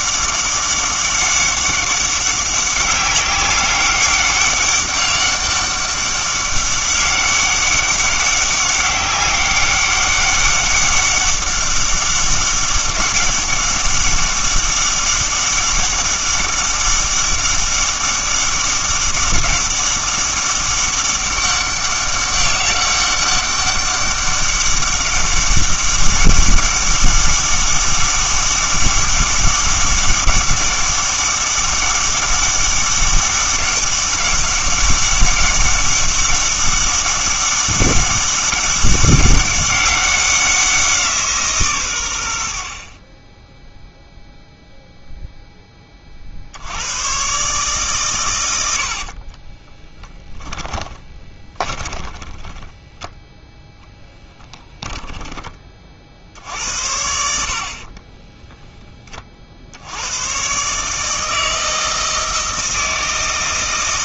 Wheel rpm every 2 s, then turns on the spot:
200, 190, 200, 200, 200, 200, 200, 200, 200, 200, 200, 200, 200, 200, 200, 200, 200, 200, 190, 200, 180, 60, 0, 80, 80, 10, 10, 10, 80, 10, 140, 160.
48-56